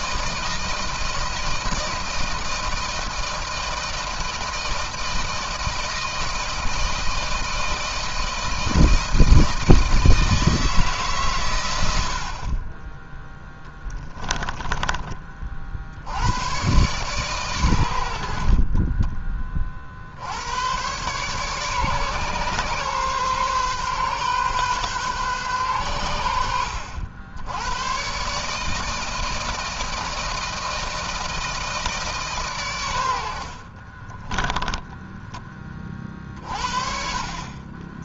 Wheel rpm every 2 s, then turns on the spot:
160, 160, 160, 160, 160, 160, 30, 20, 120, 30, 120, 130, 130, 80, 160, 160, 110, 10, 40.
18-20